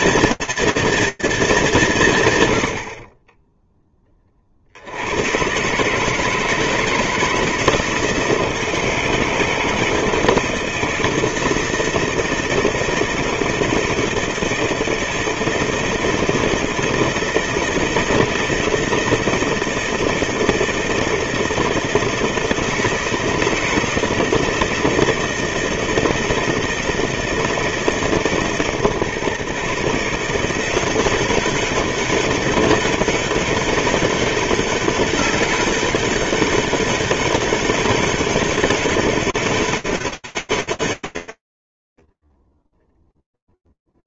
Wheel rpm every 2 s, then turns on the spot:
230, 60, 100, 160, 160, 160, 160, 160, 160, 160, 170, 160, 160, 160, 140, 190, 200, 190, 200, 190, 140, 0.
none